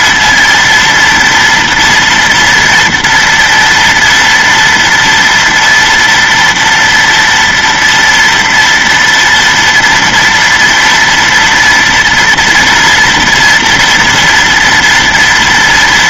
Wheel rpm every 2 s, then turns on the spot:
230, 230, 230, 230, 230, 230, 230, 240.
none